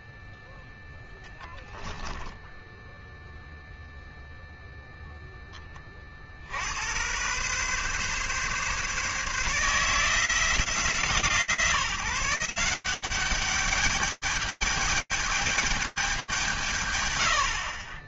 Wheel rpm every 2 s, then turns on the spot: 0, 10, 0, 80, 140, 160, 180, 210, 150.
2-4